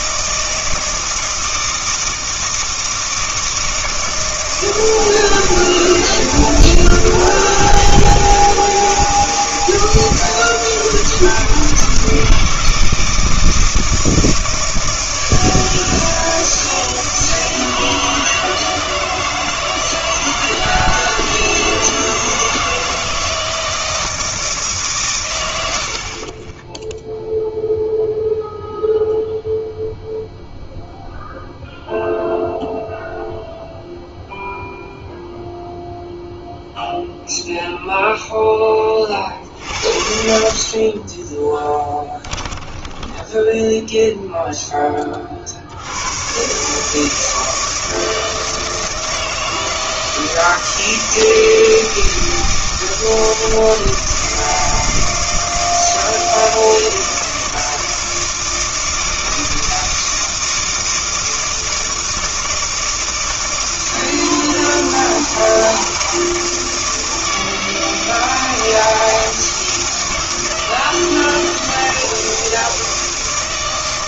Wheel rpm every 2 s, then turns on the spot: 160, 160, 160, 160, 160, 160, 160, 160, 160, 160, 160, 160, 160, 20, 0, 0, 0, 0, 0, 10, 50, 10, 0, 130, 160, 160, 160, 160, 160, 160, 160, 160, 160, 160, 160, 160, 160.
42-44